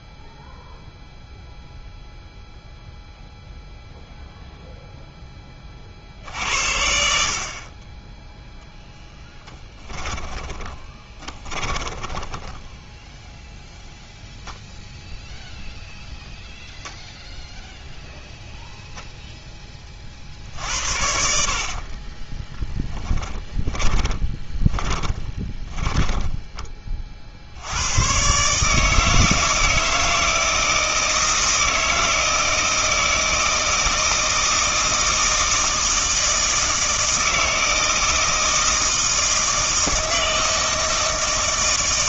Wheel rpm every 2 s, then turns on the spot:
0, 0, 0, 70, 0, 20, 10, 0, 0, 0, 70, 10, 20, 20, 150, 160, 160, 160, 160, 160, 160.
10-14 22-26